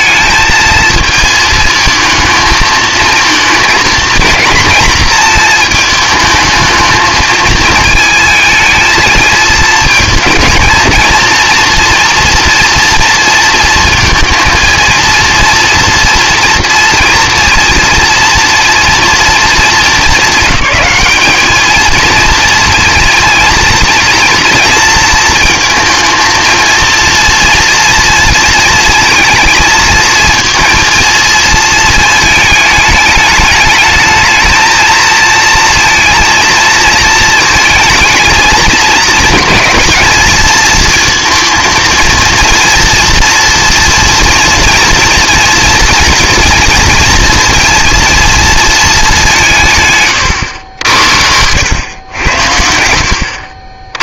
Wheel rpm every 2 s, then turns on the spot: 230, 220, 230, 220, 220, 230, 230, 230, 240, 240, 210, 230, 230, 230, 220, 220, 210, 220, 230, 220, 230, 230, 230, 230, 220, 90, 70.
50-52